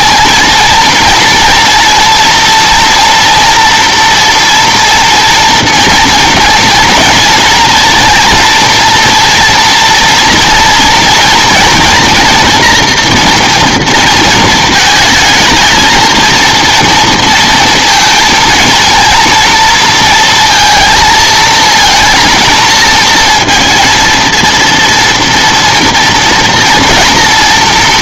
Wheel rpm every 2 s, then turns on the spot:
230, 230, 230, 230, 230, 230, 230, 220, 230, 230, 230, 230, 230, 230.
none